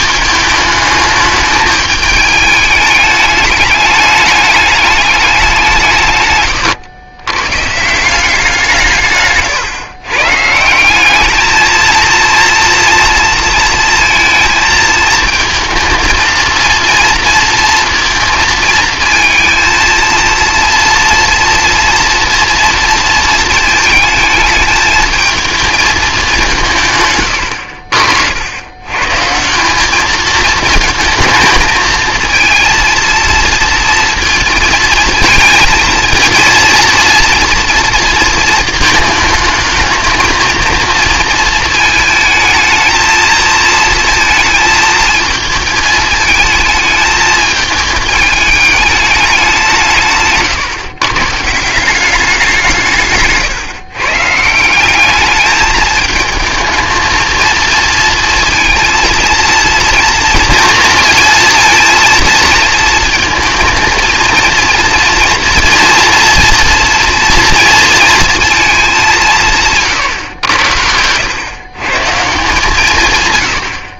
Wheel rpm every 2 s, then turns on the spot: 210, 210, 210, 120, 160, 170, 240, 220, 230, 220, 230, 230, 220, 160, 100, 220, 230, 230, 230, 220, 230, 220, 220, 220, 210, 140, 170, 170, 220, 230, 230, 230, 230, 230, 220, 90, 150.
none